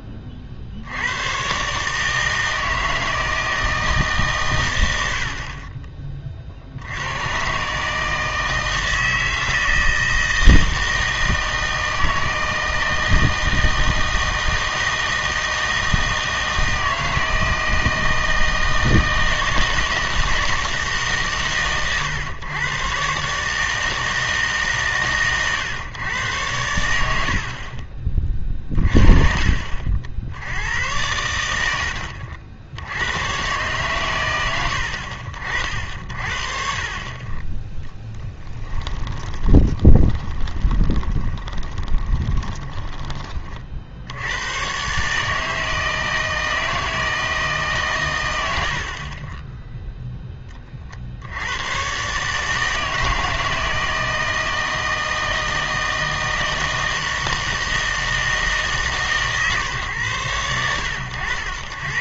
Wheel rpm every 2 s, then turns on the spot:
60, 160, 120, 60, 160, 160, 160, 160, 160, 160, 160, 120, 140, 100, 30, 90, 80, 90, 40, 10, 20, 20, 110, 160, 60, 30, 160, 160, 160, 150, 100.
38-44